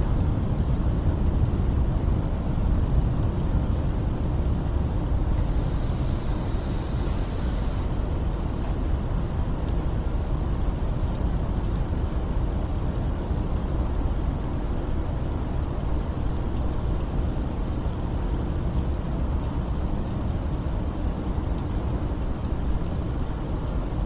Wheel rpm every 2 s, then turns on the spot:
0, 0, 0, 0, 0, 0, 0, 0, 0, 0, 0, 0.
none